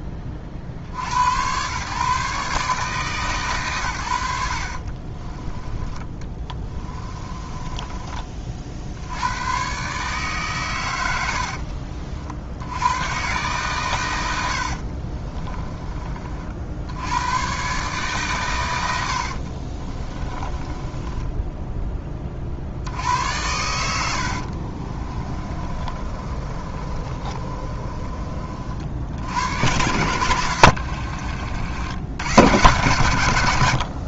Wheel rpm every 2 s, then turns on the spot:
50, 150, 50, 20, 70, 120, 90, 60, 70, 100, 20, 70, 40, 30, 60, 90, 110.
6-8 14-16 20-22 24-28 30-32